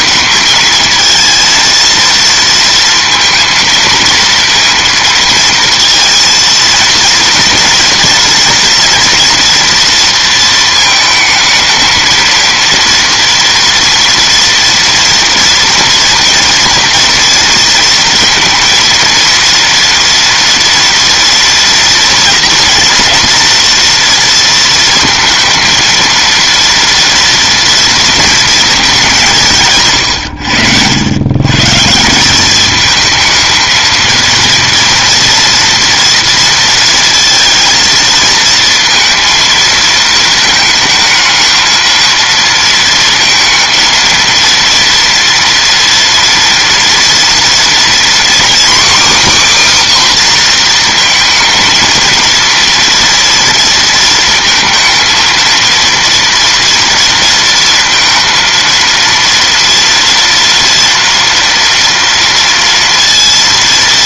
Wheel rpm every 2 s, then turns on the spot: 220, 230, 230, 230, 230, 220, 230, 230, 240, 230, 230, 230, 230, 230, 200, 90, 210, 240, 230, 230, 220, 230, 230, 230, 280, 240, 230, 230, 230, 230, 230, 230.
none